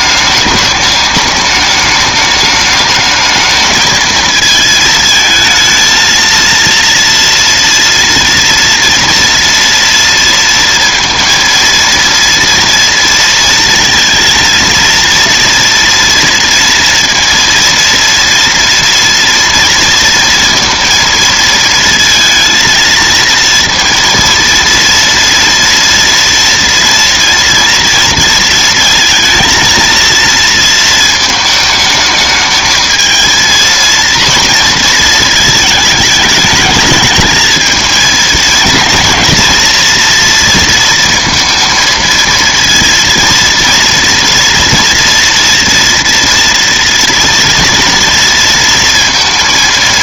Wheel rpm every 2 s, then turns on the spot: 210, 210, 220, 230, 230, 230, 240, 230, 230, 240, 230, 230, 230, 230, 230, 230, 220, 230, 220, 230, 230, 230, 230, 230, 230.
none